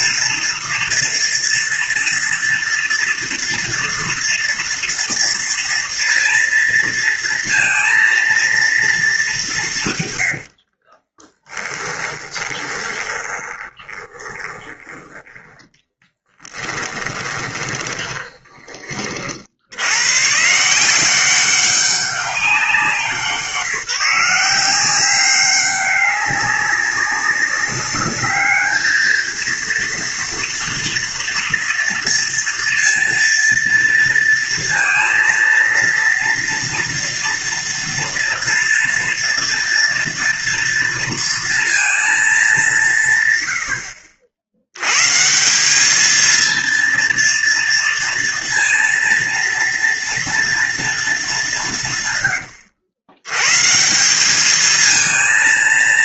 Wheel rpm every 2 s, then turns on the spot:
230, 240, 230, 230, 220, 40, 20, 10, 20, 50, 180, 190, 190, 200, 220, 240, 230, 230, 230, 240, 230, 130, 150, 230, 230, 210, 110, 230.
10-14 16-18